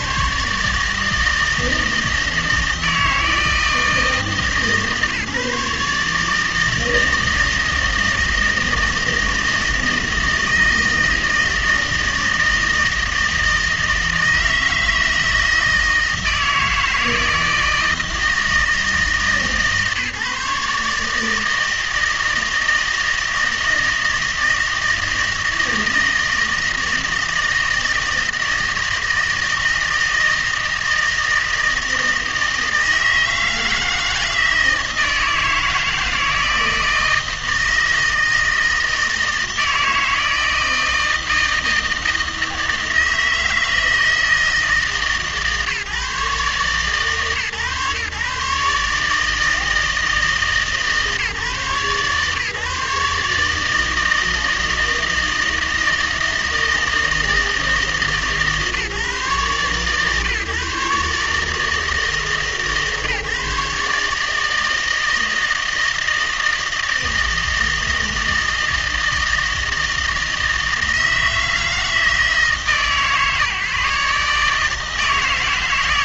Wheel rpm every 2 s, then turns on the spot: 150, 160, 140, 160, 160, 160, 160, 160, 160, 160, 140, 160, 160, 160, 160, 160, 160, 160, 160, 160, 160, 160, 160, 140, 150, 160, 150, 160, 160, 150, 150, 140, 160, 160, 160, 160, 160, 160.
none